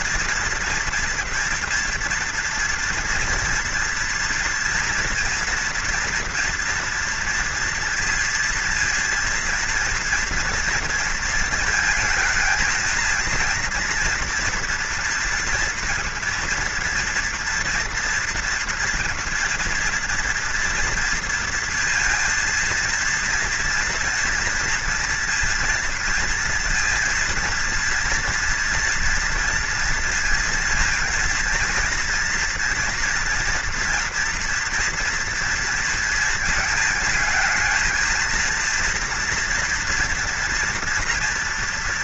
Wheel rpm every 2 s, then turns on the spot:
240, 230, 230, 230, 230, 230, 230, 240, 230, 230, 240, 230, 230, 230, 230, 230, 240, 230, 220, 230, 230.
none